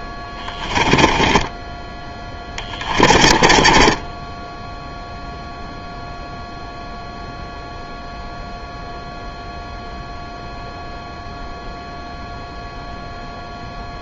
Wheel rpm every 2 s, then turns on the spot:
20, 20, 10, 0, 0, 0, 0.
0-4